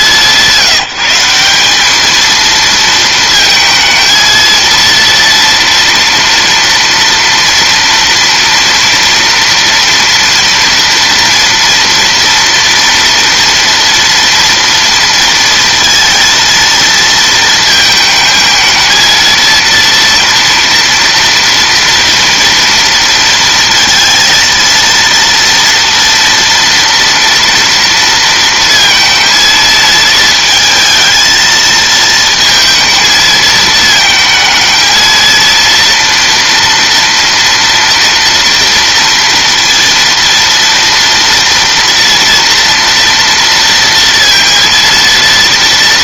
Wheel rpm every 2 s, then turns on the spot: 170, 220, 230, 230, 230, 230, 230, 230, 230, 220, 230, 230, 230, 230, 230, 220, 230, 220, 230, 230, 230, 230, 230.
none